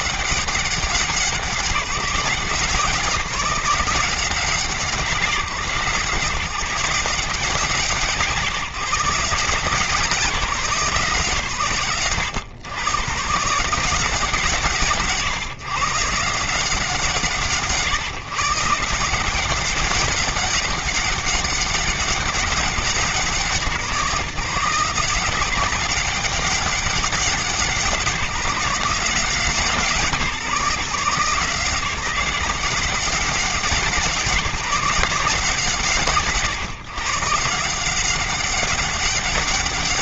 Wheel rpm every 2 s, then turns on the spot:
190, 170, 170, 160, 160, 160, 120, 140, 150, 160, 200, 190, 170, 200, 170, 160, 180, 160, 130, 190.
none